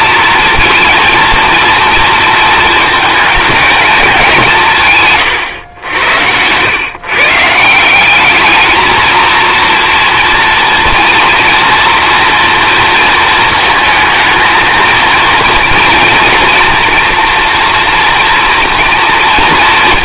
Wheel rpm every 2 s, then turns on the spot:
230, 220, 160, 120, 220, 230, 230, 230, 230, 240.
none